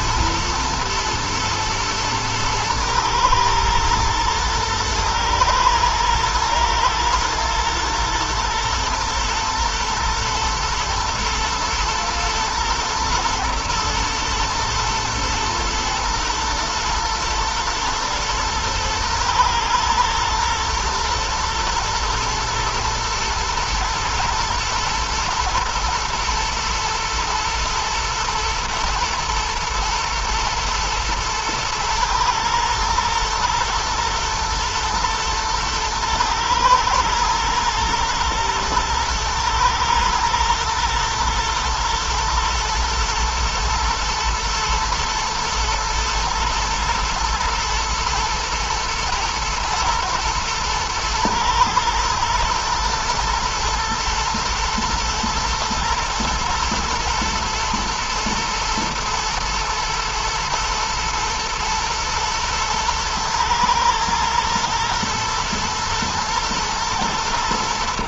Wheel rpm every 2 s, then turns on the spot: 120, 110, 110, 120, 120, 120, 120, 120, 120, 110, 120, 120, 110, 110, 110, 120, 120, 120, 120, 120, 110, 120, 120, 120, 110, 120, 120, 120, 110, 120, 120, 110, 110, 110.
none